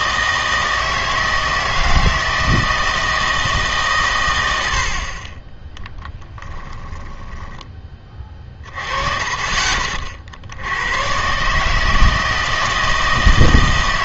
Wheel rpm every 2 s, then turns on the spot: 160, 160, 70, 10, 30, 80, 160.
6-8